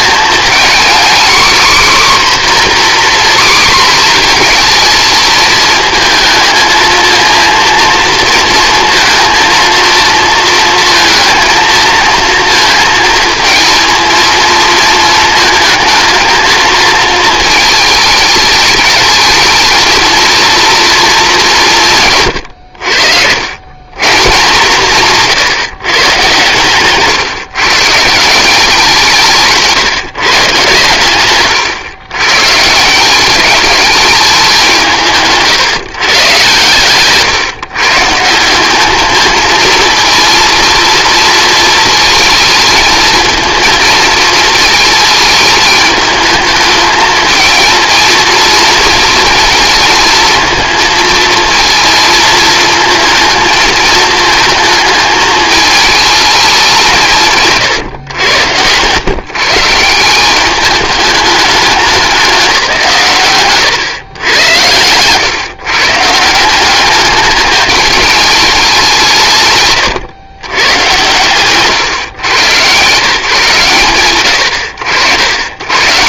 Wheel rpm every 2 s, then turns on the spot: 220, 260, 230, 230, 230, 230, 220, 230, 220, 220, 230, 110, 150, 130, 180, 140, 130, 200, 120, 180, 230, 220, 230, 210, 230, 220, 220, 220, 210, 110, 190, 180, 110, 180, 190, 140, 130, 50.
none